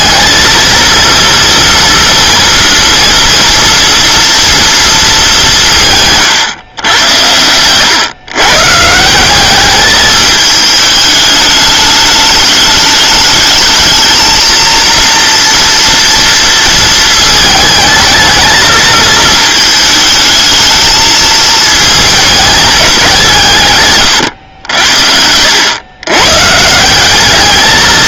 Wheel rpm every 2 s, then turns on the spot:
230, 230, 230, 120, 140, 210, 210, 230, 230, 220, 220, 210, 80, 170.
none